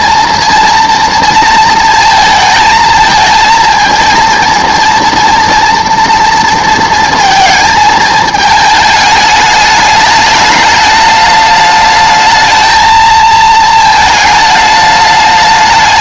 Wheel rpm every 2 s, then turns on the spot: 230, 220, 230, 230, 210, 210, 220, 210.
none